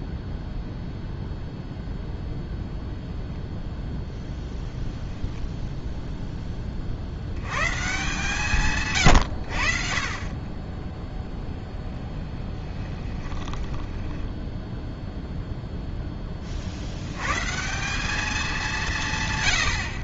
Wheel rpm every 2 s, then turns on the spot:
0, 0, 0, 10, 140, 20, 10, 0, 50, 190.
12-14